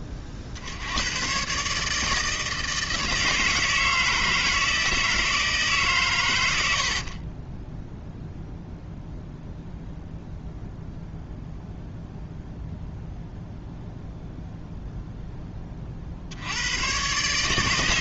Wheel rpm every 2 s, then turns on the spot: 40, 160, 160, 90, 0, 0, 0, 0, 90.
6-8